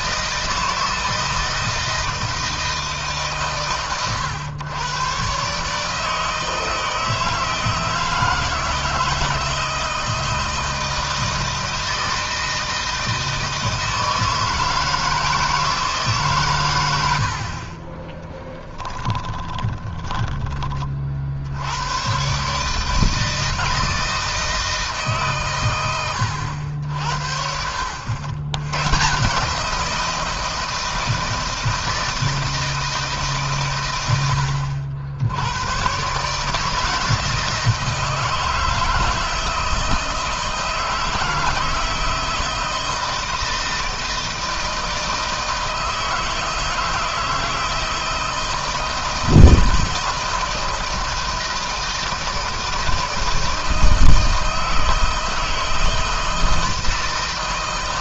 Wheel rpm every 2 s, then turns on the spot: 160, 150, 120, 160, 160, 160, 160, 160, 90, 10, 40, 150, 150, 70, 130, 160, 160, 70, 160, 160, 160, 160, 160, 160, 160, 160, 160, 160, 160.
18-20